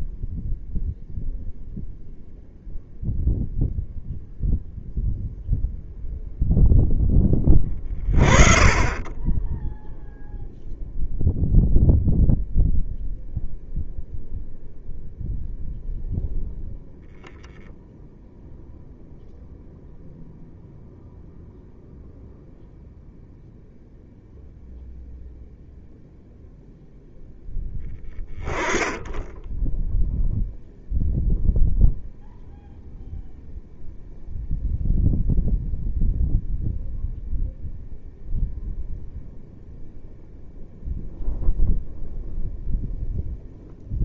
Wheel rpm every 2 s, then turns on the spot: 0, 0, 0, 0, 20, 0, 0, 0, 0, 0, 0, 0, 0, 0, 10, 0, 0, 0, 0, 0, 0, 0.
none